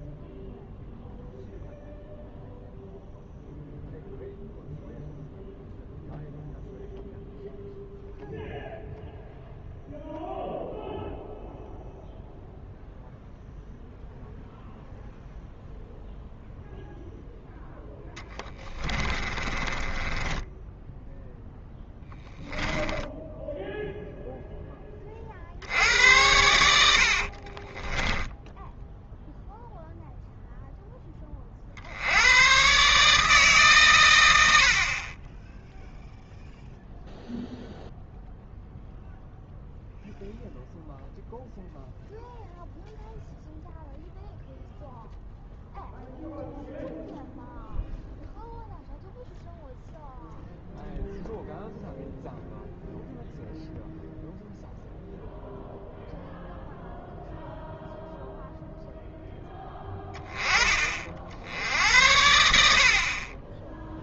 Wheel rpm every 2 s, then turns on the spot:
0, 0, 0, 0, 0, 0, 0, 0, 0, 20, 10, 10, 10, 70, 10, 0, 130, 50, 0, 0, 0, 0, 0, 0, 0, 0, 0, 0, 0, 0, 30, 70.
18-24